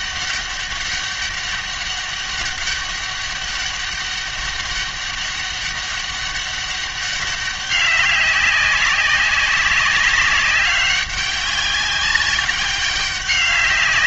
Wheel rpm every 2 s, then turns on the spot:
200, 200, 200, 200, 190, 190, 190.
none